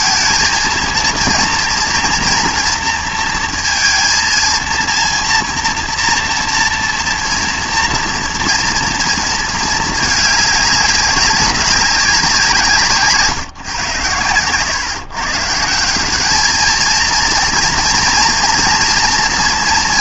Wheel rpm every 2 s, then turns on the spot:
230, 230, 220, 230, 230, 210, 170, 110, 210, 230.
none